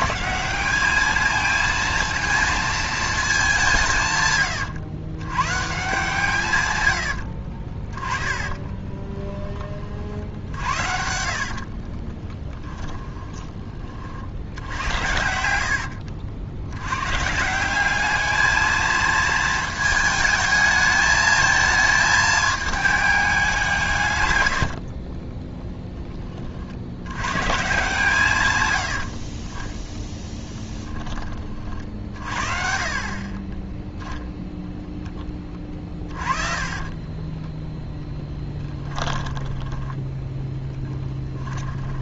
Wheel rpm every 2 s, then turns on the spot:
200, 220, 100, 110, 10, 70, 10, 80, 90, 220, 220, 210, 50, 60, 100, 10, 40, 0, 30, 10, 10.
6-16 24-26 36-42